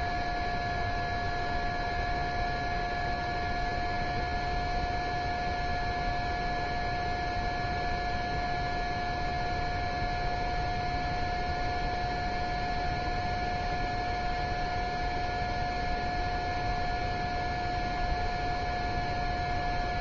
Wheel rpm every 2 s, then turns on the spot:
0, 0, 0, 0, 0, 0, 0, 0, 0, 0.
none